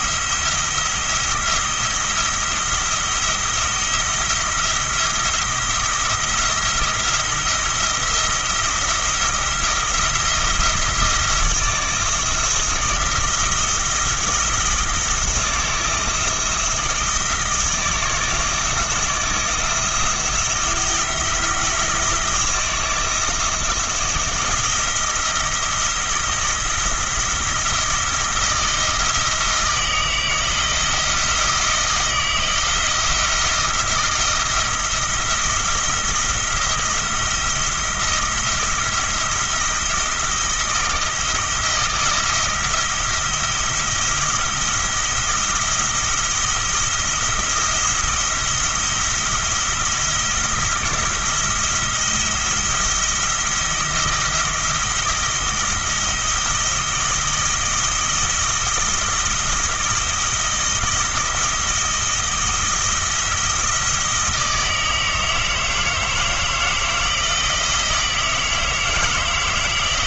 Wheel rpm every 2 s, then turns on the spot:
170, 170, 170, 170, 170, 170, 170, 170, 170, 160, 160, 170, 170, 170, 170, 170, 170, 170, 170, 170, 160, 160, 170, 170, 170, 170, 170, 170, 170, 160, 160, 160, 160, 160, 160.
none